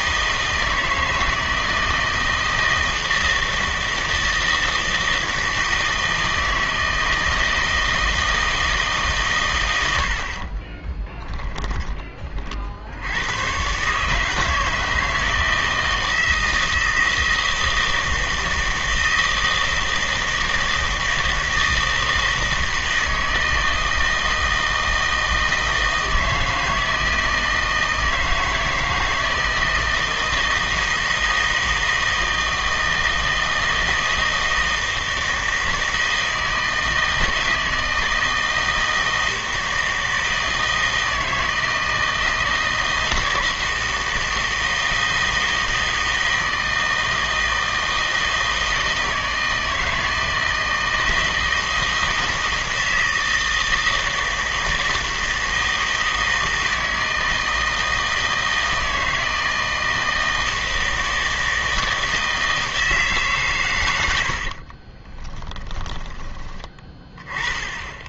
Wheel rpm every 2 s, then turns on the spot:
160, 160, 160, 160, 160, 20, 60, 160, 160, 160, 160, 160, 160, 160, 160, 160, 160, 160, 160, 160, 160, 160, 170, 160, 160, 160, 160, 160, 160, 160, 160, 160, 50, 20.
10-12 64-66